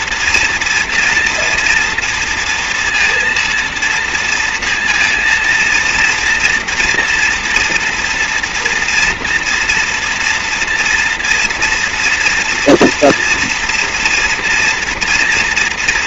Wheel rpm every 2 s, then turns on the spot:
230, 230, 230, 230, 230, 230, 230, 240.
none